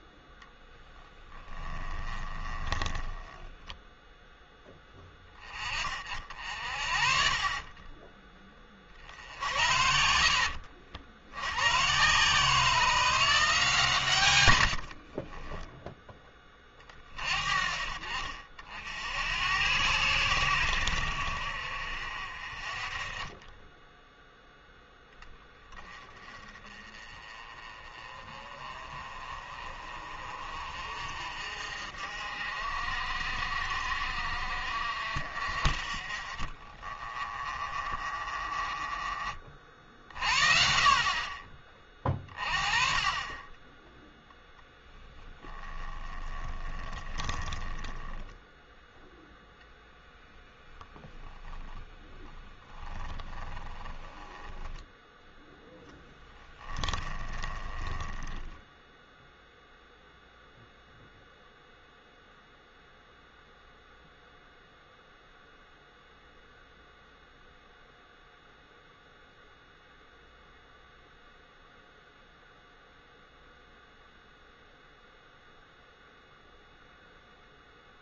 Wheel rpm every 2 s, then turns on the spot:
10, 20, 10, 50, 30, 60, 170, 80, 30, 60, 90, 40, 10, 30, 30, 50, 50, 50, 30, 20, 40, 30, 10, 10, 0, 0, 10, 10, 20, 10, 0, 0, 0, 0, 0, 0, 0, 0, 0.
0-4 14-16 40-42 46-48 52-60